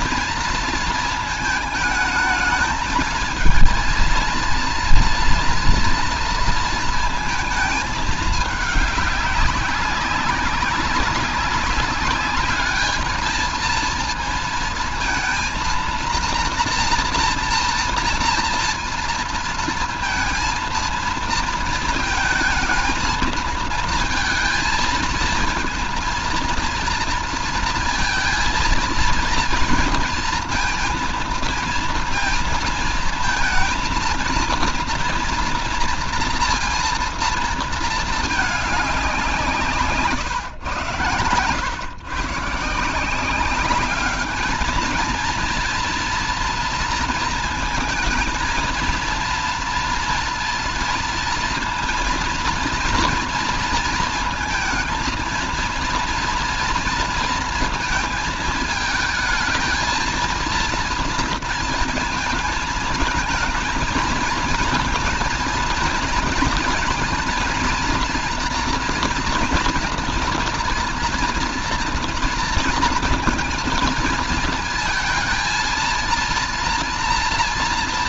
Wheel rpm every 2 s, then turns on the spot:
230, 220, 230, 230, 210, 200, 210, 230, 230, 230, 230, 230, 220, 230, 220, 230, 230, 230, 230, 220, 130, 140, 210, 230, 220, 230, 230, 230, 230, 220, 230, 230, 220, 230, 230, 230, 230, 220, 220.
none